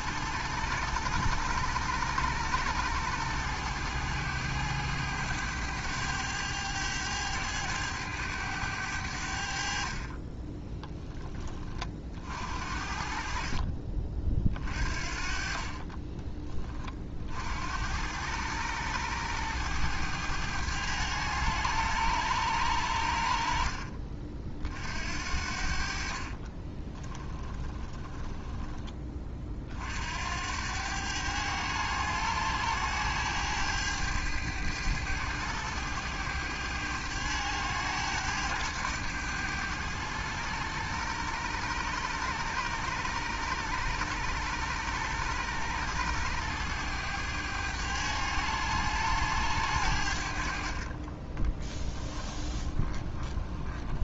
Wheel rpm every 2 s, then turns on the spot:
100, 100, 100, 100, 80, 10, 50, 40, 30, 100, 100, 70, 60, 20, 20, 100, 100, 100, 100, 110, 100, 100, 100, 100, 100, 30, 20.
26-28 50-54